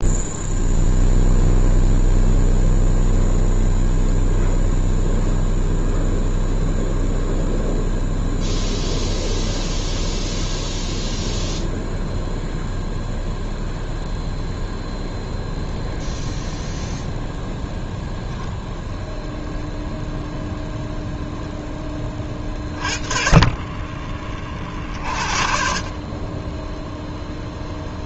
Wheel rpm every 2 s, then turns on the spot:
0, 0, 0, 0, 0, 0, 0, 0, 0, 0, 0, 30, 40, 0.
none